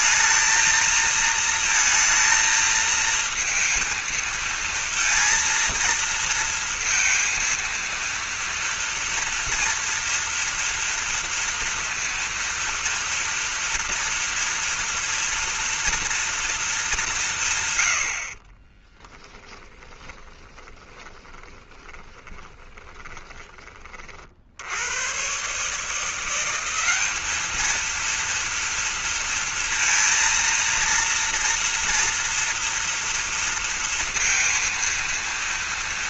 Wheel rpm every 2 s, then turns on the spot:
230, 230, 230, 230, 230, 230, 230, 230, 210, 20, 20, 20, 100, 190, 230, 230, 230, 230.
18-24